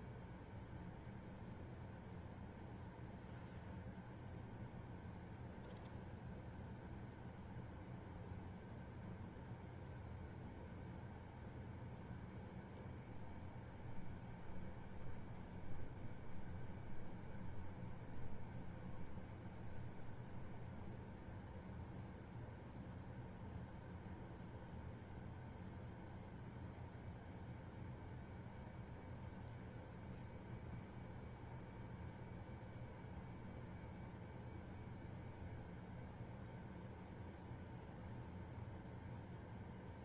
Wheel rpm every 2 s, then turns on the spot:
0, 0, 0, 0, 0, 0, 0, 0, 0, 0, 0, 0, 0, 0, 0, 0, 0, 0, 0, 0.
none